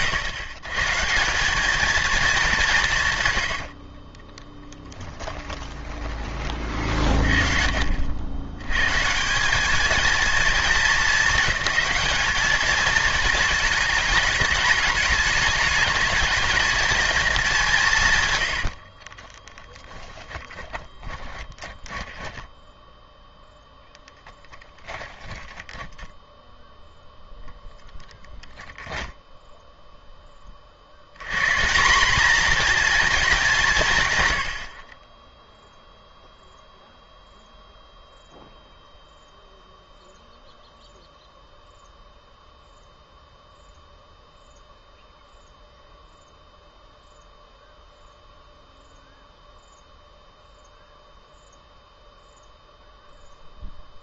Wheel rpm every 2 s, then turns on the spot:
140, 170, 10, 40, 130, 220, 220, 210, 230, 60, 10, 10, 10, 0, 0, 60, 240, 40, 0, 0, 0, 0, 0, 0, 0, 0, 0.
4-6 18-26